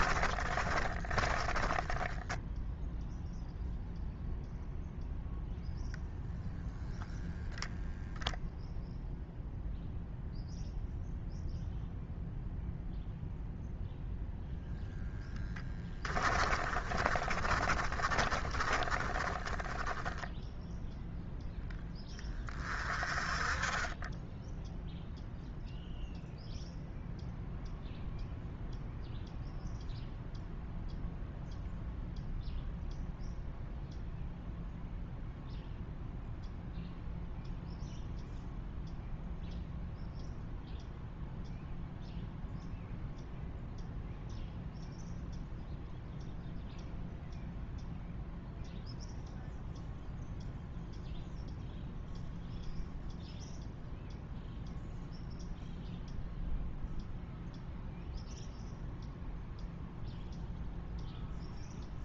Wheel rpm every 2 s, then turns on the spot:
20, 0, 0, 0, 0, 0, 0, 0, 30, 20, 0, 30, 0, 0, 0, 0, 0, 0, 0, 0, 0, 0, 0, 0, 0, 0, 0, 0, 0, 0, 0.
0-2 16-20